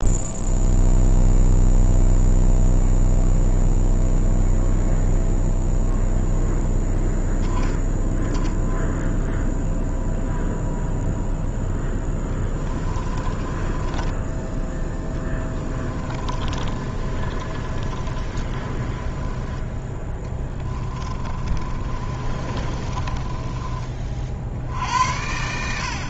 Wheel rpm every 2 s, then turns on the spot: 0, 0, 0, 0, 0, 0, 20, 10, 30, 20, 30, 30, 80.
12-26